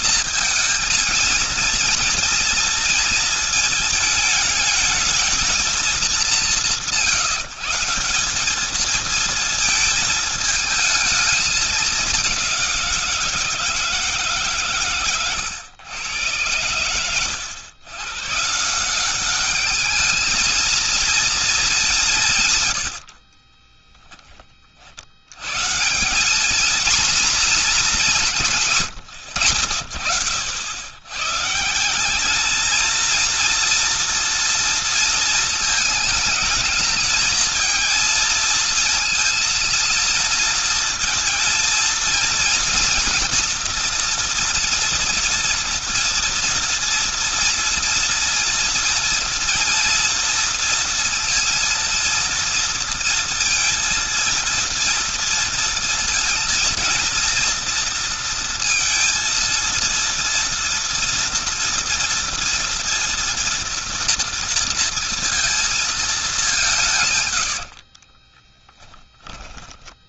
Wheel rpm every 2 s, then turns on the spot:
220, 230, 220, 180, 220, 220, 170, 130, 120, 190, 230, 70, 80, 240, 100, 120, 230, 230, 220, 220, 230, 230, 230, 230, 230, 230, 230, 230, 230, 230, 230, 230, 230, 130, 10.
22-24 66-68